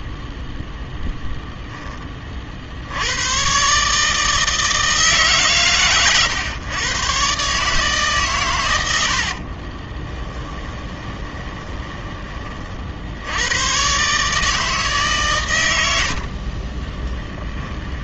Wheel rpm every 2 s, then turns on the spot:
0, 10, 150, 130, 140, 30, 20, 130, 80.
10-14 16-18